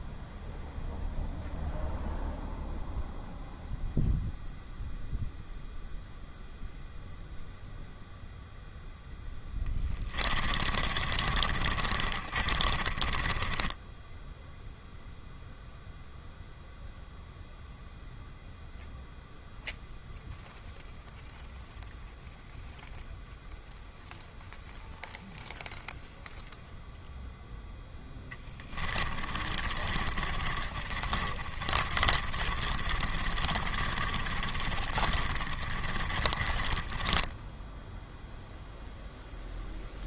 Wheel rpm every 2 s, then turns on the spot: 0, 0, 0, 0, 0, 30, 20, 0, 0, 0, 0, 0, 0, 0, 20, 30, 30, 30, 20, 0.
10-14 28-38